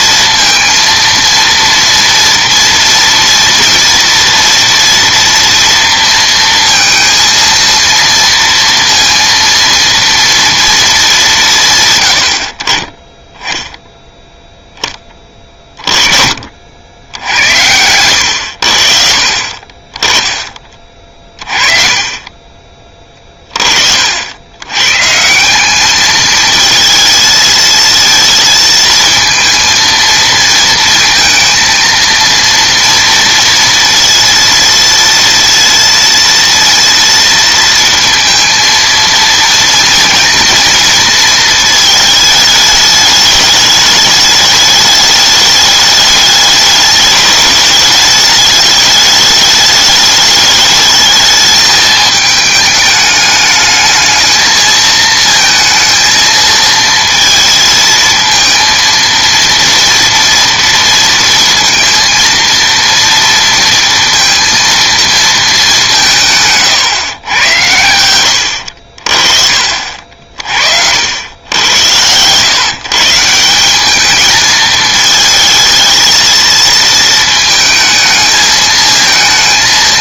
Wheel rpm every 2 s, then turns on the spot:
230, 230, 230, 230, 230, 230, 50, 10, 70, 60, 30, 30, 110, 220, 230, 230, 230, 230, 230, 230, 230, 220, 210, 210, 210, 210, 210, 220, 230, 230, 230, 230, 230, 150, 70, 50, 140, 220, 230, 220.
20-22 70-72